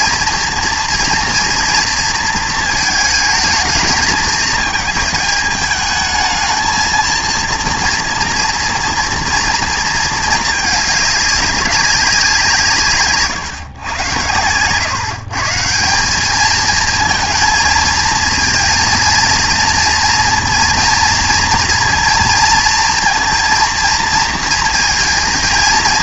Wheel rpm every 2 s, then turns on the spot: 230, 220, 220, 220, 230, 220, 160, 130, 220, 230, 230, 230, 230.
none